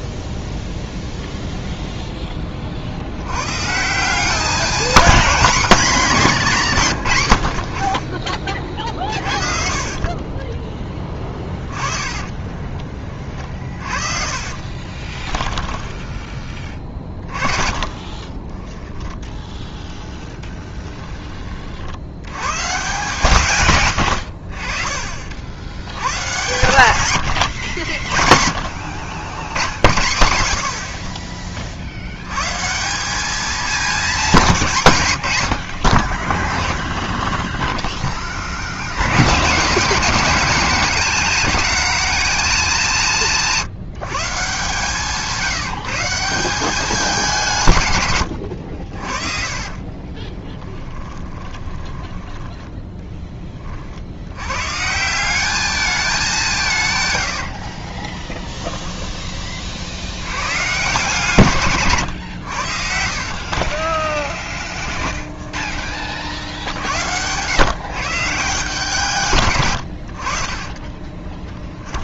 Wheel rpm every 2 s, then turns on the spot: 0, 60, 230, 160, 40, 10, 20, 40, 20, 20, 10, 130, 50, 120, 60, 70, 140, 170, 20, 70, 220, 210, 150, 180, 60, 20, 10, 120, 170, 10, 130, 80, 10, 70, 160, 50.
8-10 12-20 36-38 48-52 58-60 64-66 70-72